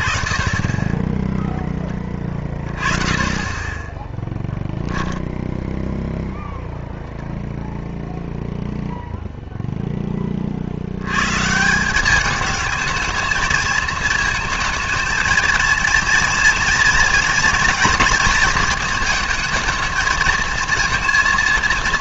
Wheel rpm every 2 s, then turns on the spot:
10, 20, 0, 0, 0, 50, 210, 220, 230, 230, 230.
none